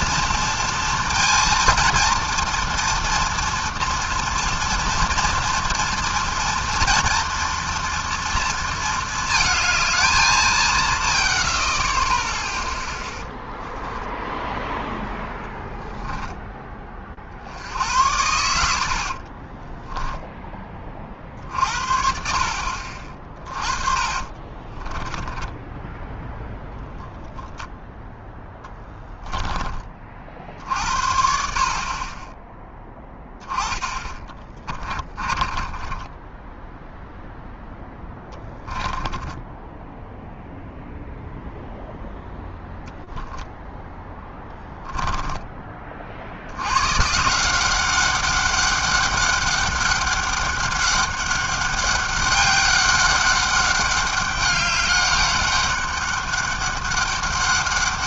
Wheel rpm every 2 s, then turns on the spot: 230, 230, 230, 230, 230, 190, 0, 0, 10, 80, 10, 60, 30, 0, 10, 50, 10, 30, 10, 10, 0, 0, 10, 80, 200, 200, 200, 200, 200.
24-26 28-30 34-40 44-46